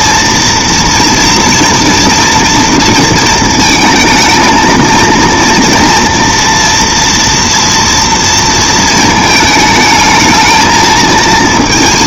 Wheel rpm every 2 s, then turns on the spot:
230, 230, 230, 230, 220, 220.
none